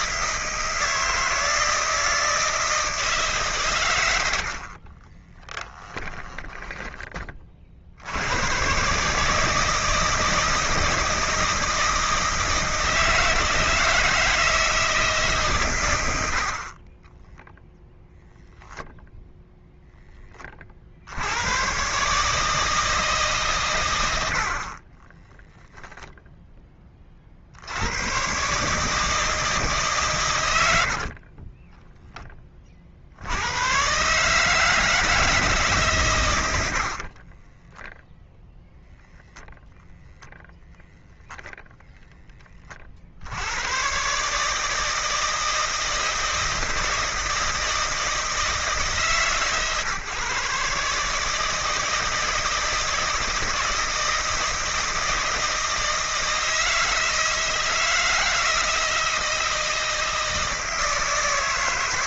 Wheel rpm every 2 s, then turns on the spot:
160, 160, 50, 20, 120, 160, 160, 160, 50, 0, 40, 160, 50, 10, 140, 90, 40, 150, 80, 0, 0, 30, 150, 160, 150, 140, 160, 160, 170, 160, 160.
6-8 16-18 30-32 36-38